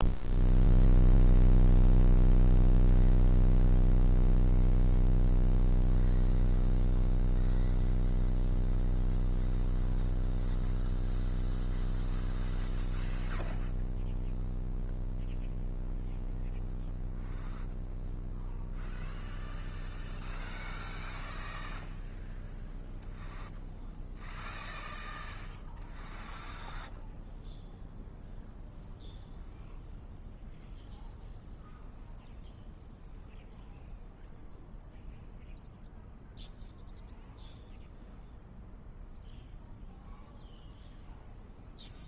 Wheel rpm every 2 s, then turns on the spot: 0, 0, 0, 0, 0, 0, 0, 0, 0, 0, 0, 0, 0, 0, 0, 0, 0, 0, 0, 0, 0.
none